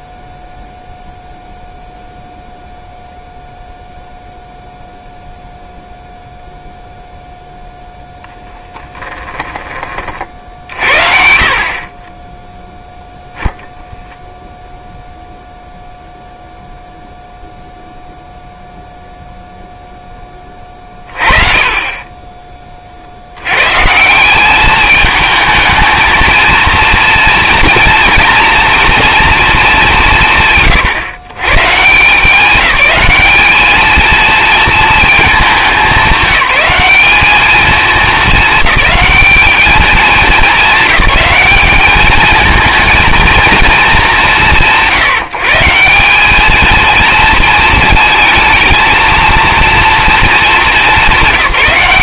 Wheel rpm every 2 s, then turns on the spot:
0, 0, 0, 0, 0, 50, 0, 0, 0, 0, 20, 20, 200, 230, 240, 140, 200, 230, 190, 210, 210, 220, 150, 220, 230, 220.
none